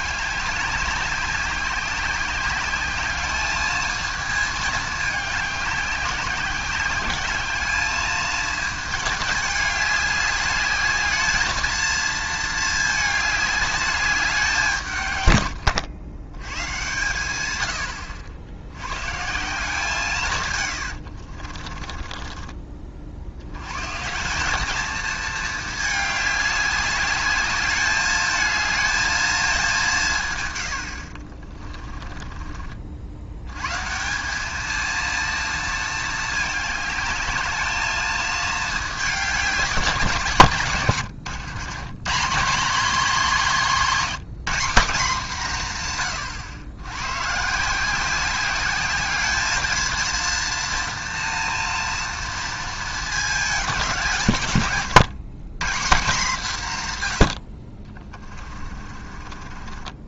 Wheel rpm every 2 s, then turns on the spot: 200, 200, 210, 190, 220, 210, 220, 160, 110, 90, 110, 30, 210, 200, 220, 110, 50, 220, 210, 210, 130, 210, 210, 100, 200, 230, 230, 120, 160, 30.
20-22 54-56 58-60